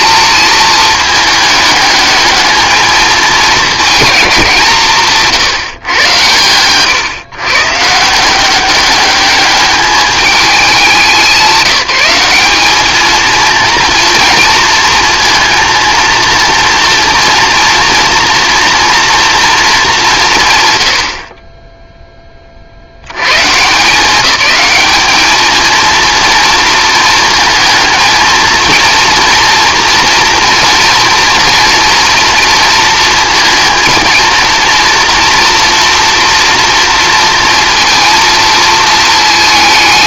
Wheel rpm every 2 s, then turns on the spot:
220, 220, 160, 130, 200, 190, 210, 230, 230, 230, 130, 60, 210, 230, 230, 230, 230, 230, 240, 220.
none